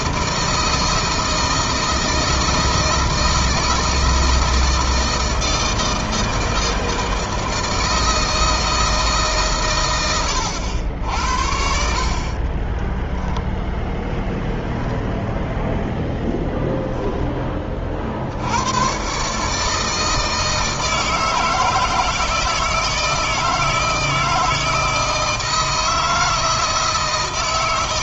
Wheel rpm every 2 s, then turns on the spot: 160, 160, 170, 160, 160, 80, 30, 0, 0, 90, 160, 160, 160, 160.
12-14